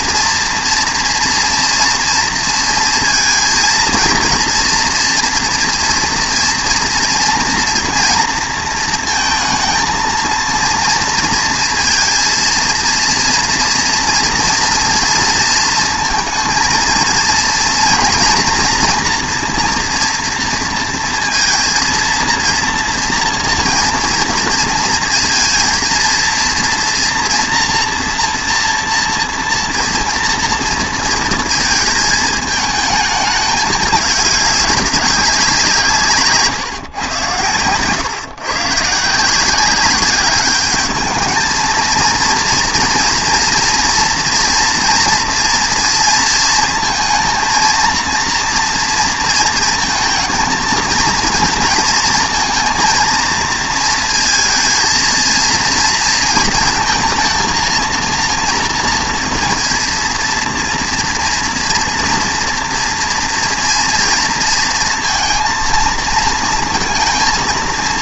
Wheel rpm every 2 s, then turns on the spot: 240, 230, 230, 230, 230, 230, 230, 230, 230, 240, 230, 230, 220, 230, 230, 230, 220, 200, 130, 150, 210, 240, 240, 220, 230, 230, 230, 230, 230, 230, 230, 230, 230, 230.
none